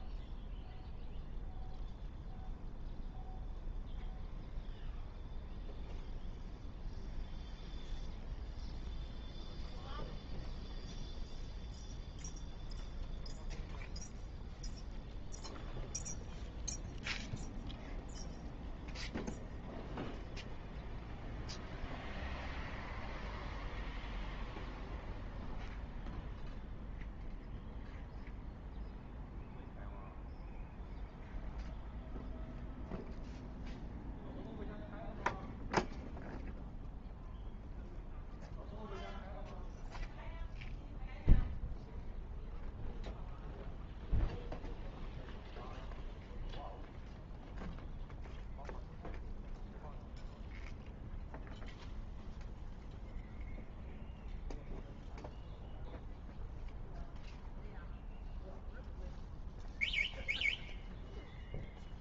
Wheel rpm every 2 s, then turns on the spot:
0, 0, 0, 0, 0, 0, 0, 0, 0, 0, 0, 0, 0, 0, 0, 0, 0, 0, 0, 0, 0, 0, 0, 0, 0, 0, 0, 0, 0, 0, 0.
none